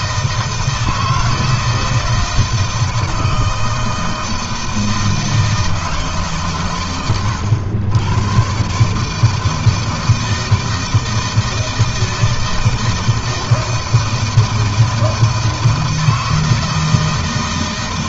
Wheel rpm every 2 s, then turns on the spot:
160, 160, 160, 150, 120, 160, 160, 160, 160.
none